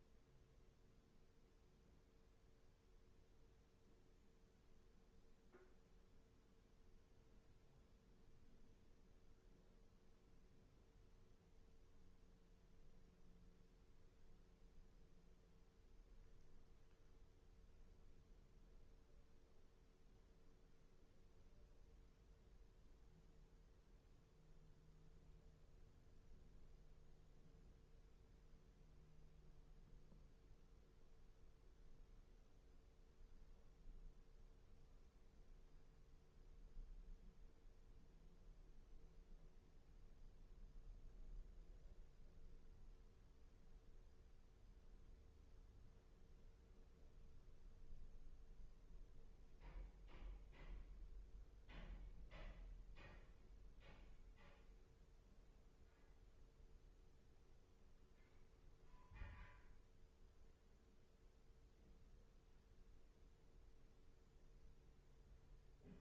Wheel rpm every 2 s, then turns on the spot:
0, 0, 0, 0, 0, 0, 0, 0, 0, 0, 0, 0, 0, 0, 0, 0, 0, 0, 0, 0, 0, 0, 0, 0, 0, 0, 0, 0, 0, 0, 0, 0, 0.
none